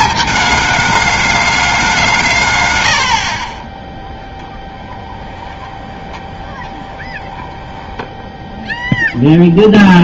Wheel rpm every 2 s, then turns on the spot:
220, 130, 10, 20, 0.
4-8